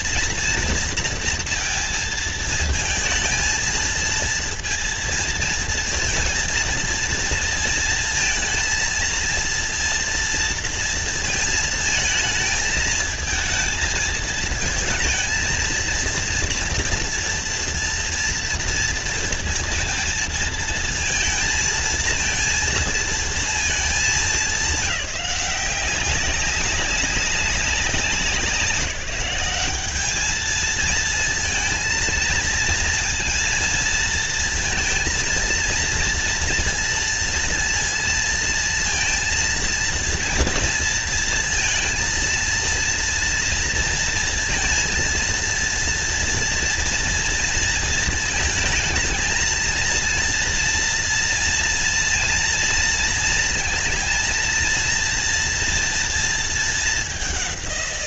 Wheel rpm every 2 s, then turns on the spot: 230, 220, 230, 230, 230, 230, 220, 220, 230, 230, 230, 230, 200, 190, 180, 220, 230, 230, 230, 230, 230, 230, 230, 230, 220, 230, 230, 230, 230.
none